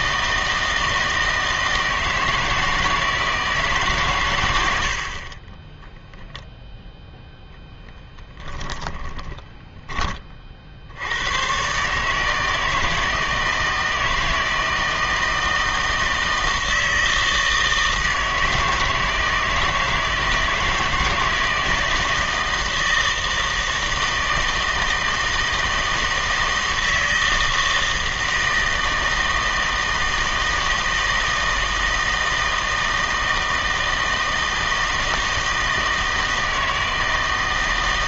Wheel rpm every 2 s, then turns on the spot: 160, 160, 90, 0, 20, 60, 160, 160, 160, 160, 160, 160, 160, 160, 160, 160, 160, 160, 160.
8-10